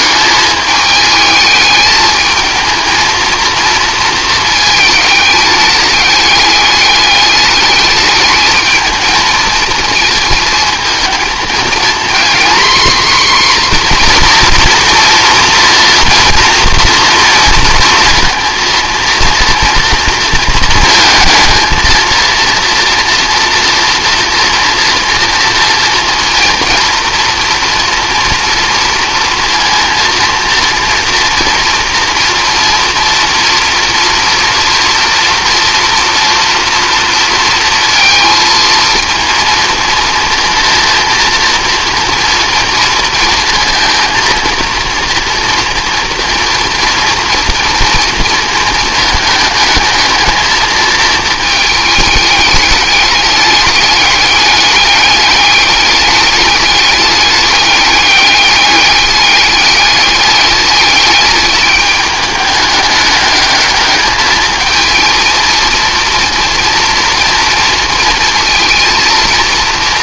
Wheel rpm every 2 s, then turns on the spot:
210, 220, 220, 200, 220, 220, 240, 230, 230, 230, 230, 230, 230, 230, 230, 230, 230, 240, 240, 230, 240, 230, 230, 230, 230, 220, 210, 210, 200, 200, 210, 210, 230, 230, 230.
none